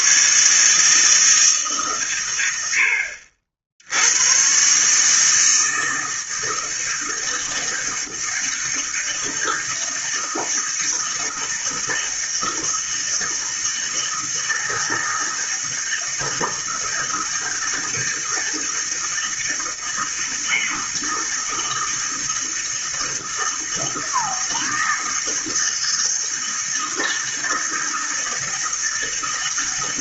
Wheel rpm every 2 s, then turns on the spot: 150, 90, 130, 160, 160, 160, 160, 160, 160, 160, 160, 160, 160, 160, 160.
none